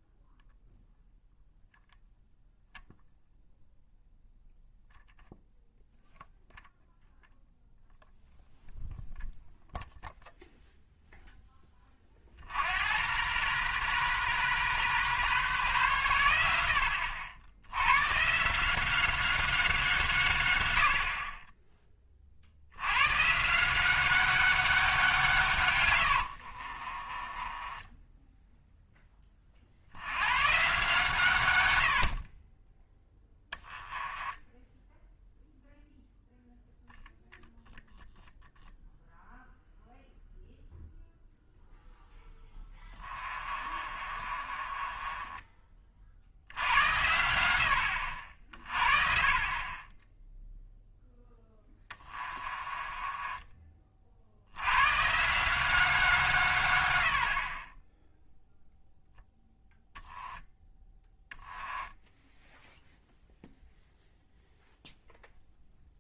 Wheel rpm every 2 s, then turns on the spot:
0, 0, 0, 0, 0, 0, 80, 130, 80, 180, 90, 90, 190, 40, 0, 130, 20, 10, 10, 0, 0, 20, 30, 80, 30, 0, 20, 110, 110, 0, 10, 0, 0.
26-28 32-36 42-46 52-54